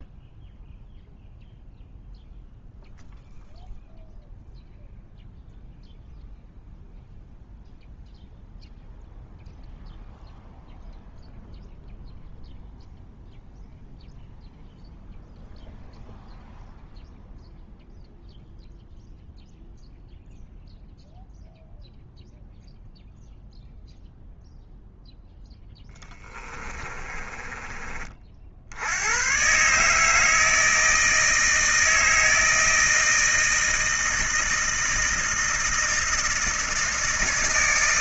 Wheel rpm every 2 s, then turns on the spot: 0, 0, 0, 0, 0, 0, 0, 0, 0, 0, 0, 0, 0, 20, 60, 160, 160, 160, 160.
26-28